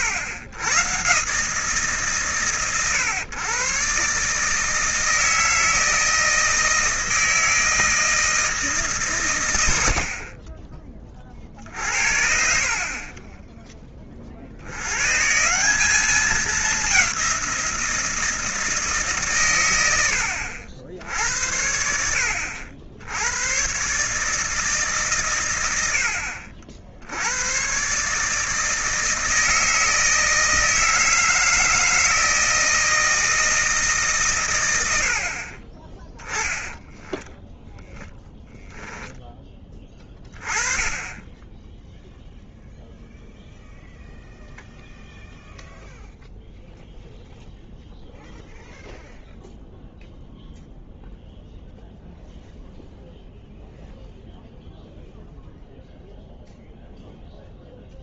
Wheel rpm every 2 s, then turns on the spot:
110, 120, 160, 160, 160, 30, 40, 90, 200, 160, 60, 70, 150, 60, 160, 160, 160, 110, 10, 0, 20, 0, 0, 0, 0, 0, 0, 0, 0.
none